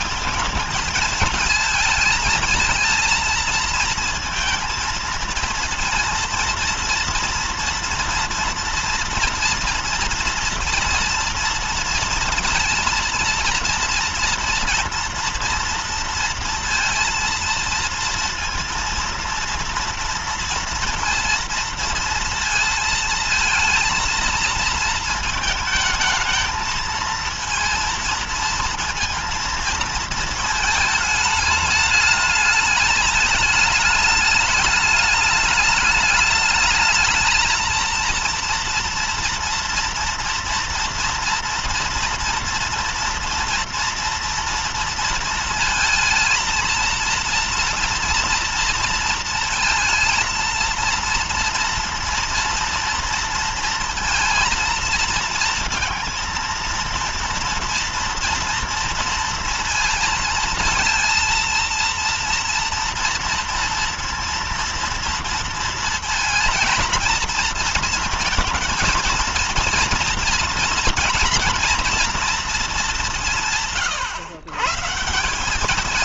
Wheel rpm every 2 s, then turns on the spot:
230, 230, 230, 230, 230, 230, 230, 230, 230, 230, 230, 230, 230, 220, 230, 220, 210, 210, 210, 230, 230, 230, 230, 230, 230, 230, 230, 230, 230, 230, 230, 230, 230, 230, 230, 230, 230, 120.
none